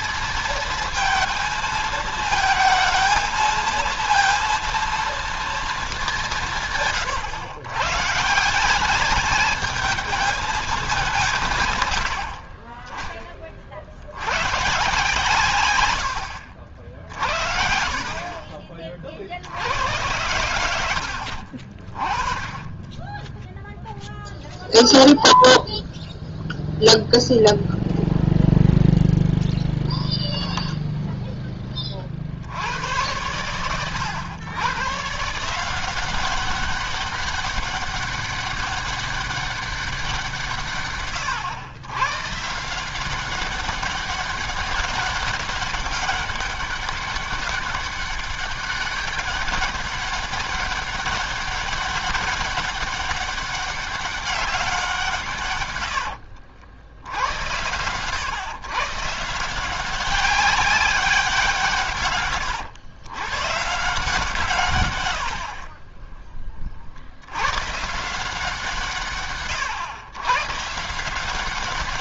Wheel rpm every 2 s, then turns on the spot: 230, 220, 230, 110, 210, 190, 20, 120, 60, 40, 80, 20, 0, 0, 0, 0, 70, 100, 190, 200, 160, 140, 200, 200, 200, 200, 200, 200, 80, 120, 190, 140, 150, 30, 160, 130.
56-58